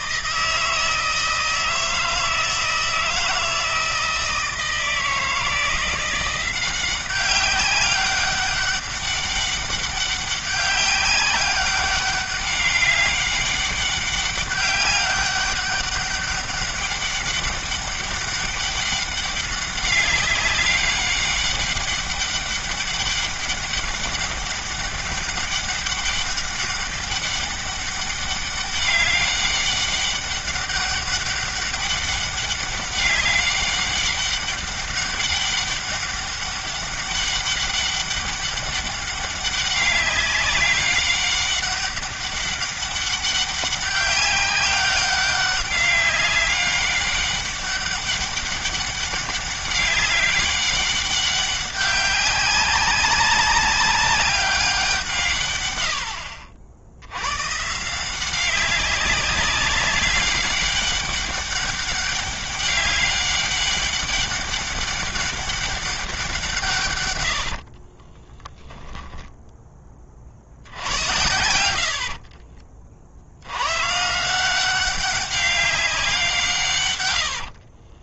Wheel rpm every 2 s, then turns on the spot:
160, 160, 160, 190, 200, 190, 200, 200, 200, 200, 200, 200, 200, 200, 200, 200, 200, 200, 200, 200, 200, 200, 200, 200, 200, 200, 190, 170, 90, 190, 200, 200, 200, 130, 10, 80, 70, 190, 110.
66-72 76-78